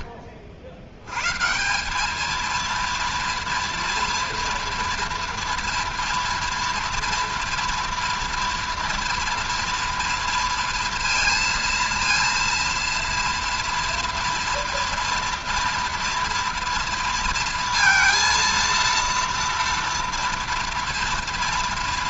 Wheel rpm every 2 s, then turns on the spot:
90, 230, 230, 230, 230, 230, 230, 230, 230, 230, 230.
none